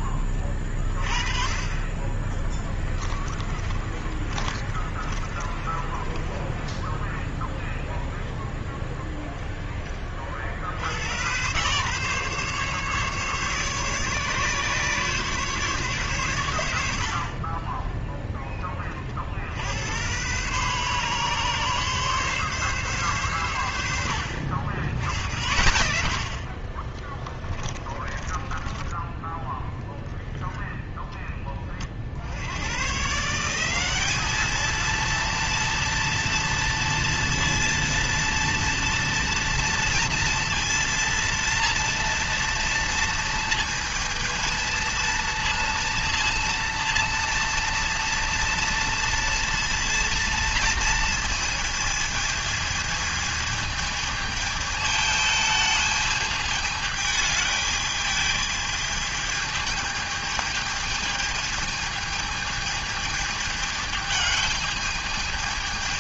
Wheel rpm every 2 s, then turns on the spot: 10, 20, 40, 30, 0, 40, 140, 140, 110, 10, 110, 140, 90, 60, 20, 10, 70, 210, 230, 230, 230, 230, 230, 230, 230, 230, 220, 220, 210, 210, 210, 220, 210.
2-8 28-30